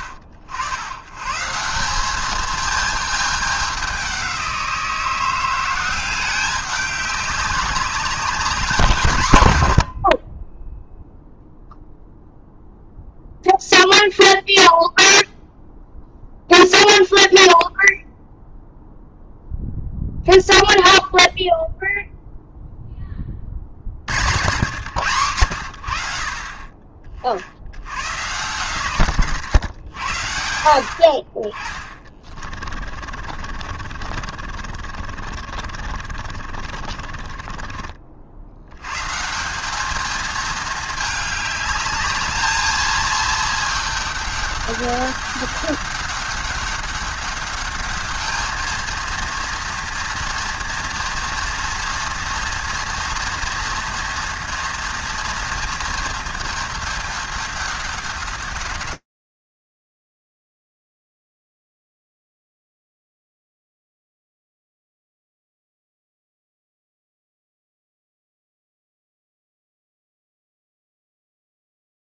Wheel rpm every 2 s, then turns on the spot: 100, 220, 170, 200, 190, 0, 0, 0, 0, 0, 0, 10, 130, 40, 120, 60, 30, 40, 40, 110, 220, 220, 200, 200, 220, 230, 240, 230, 210, 200, 150, 140, 110, 80, 70, 0.
32-38